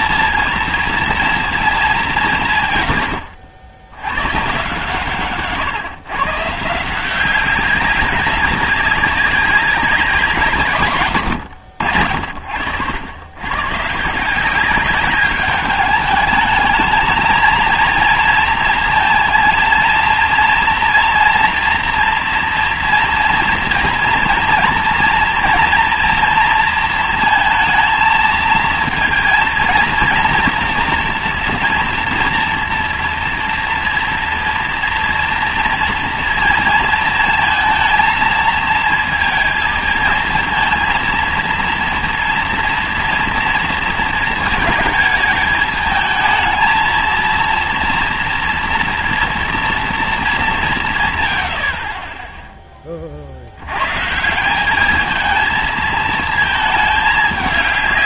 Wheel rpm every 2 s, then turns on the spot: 230, 140, 140, 160, 200, 150, 80, 190, 210, 220, 240, 240, 230, 230, 220, 230, 240, 230, 230, 220, 230, 230, 220, 230, 230, 200, 20, 210, 220.
none